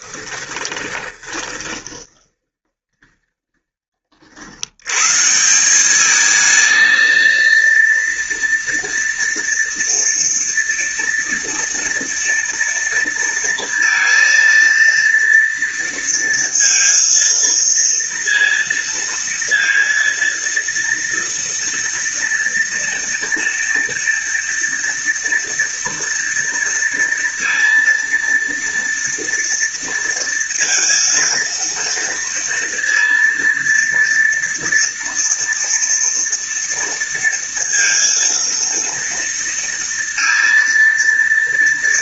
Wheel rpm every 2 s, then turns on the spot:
10, 20, 110, 230, 230, 230, 230, 230, 230, 230, 230, 230, 230, 230, 230, 230, 230, 230, 230, 230, 230.
0-4